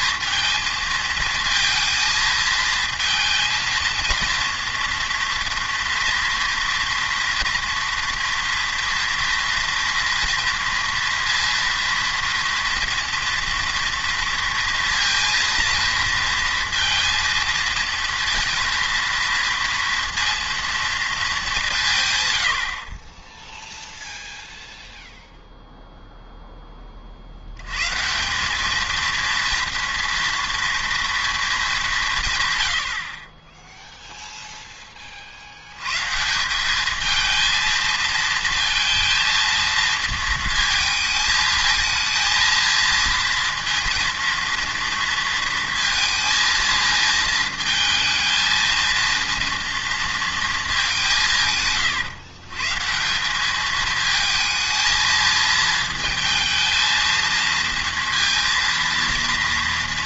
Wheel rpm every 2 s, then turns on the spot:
220, 220, 230, 230, 230, 230, 230, 230, 230, 230, 230, 60, 0, 10, 200, 240, 100, 10, 200, 230, 230, 230, 230, 220, 230, 210, 150, 220, 220, 230.
none